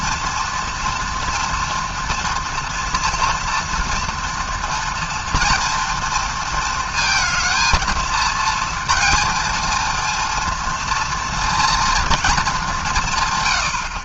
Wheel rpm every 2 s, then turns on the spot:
240, 230, 230, 230, 230, 230, 210.
none